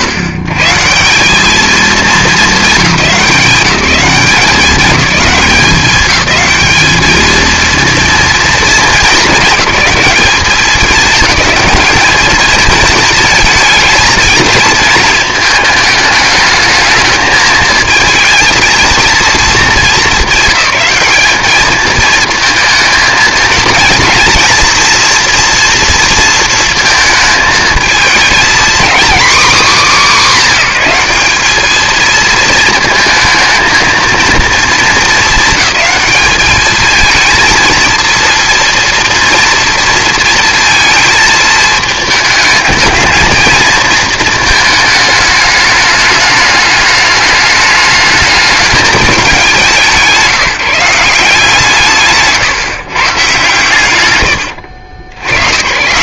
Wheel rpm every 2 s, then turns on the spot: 140, 180, 190, 220, 220, 210, 230, 220, 220, 230, 200, 220, 230, 230, 230, 220, 220, 220, 210, 230, 230, 220, 220, 210, 210, 180, 140, 90.
none